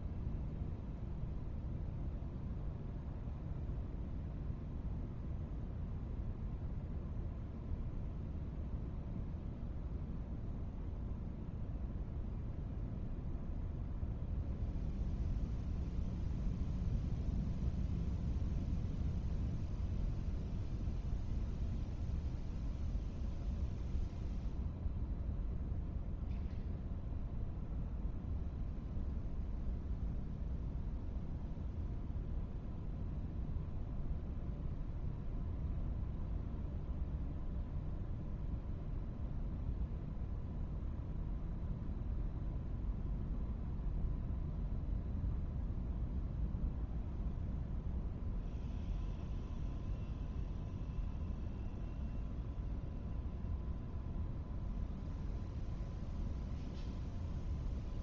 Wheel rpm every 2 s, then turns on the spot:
0, 0, 0, 0, 0, 0, 0, 0, 0, 0, 0, 0, 0, 0, 0, 0, 0, 0, 0, 0, 0, 0, 0, 0, 0, 0, 0, 0, 0.
none